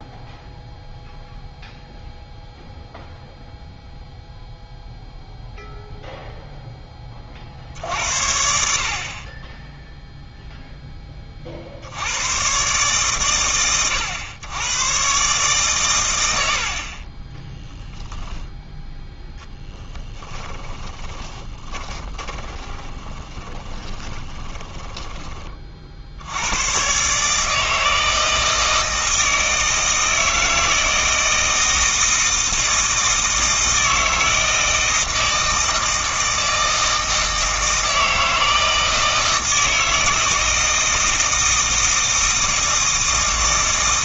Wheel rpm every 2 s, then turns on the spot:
0, 0, 0, 20, 60, 10, 130, 110, 50, 0, 10, 30, 10, 120, 160, 160, 160, 160, 160, 160, 160, 160.
16-18 20-26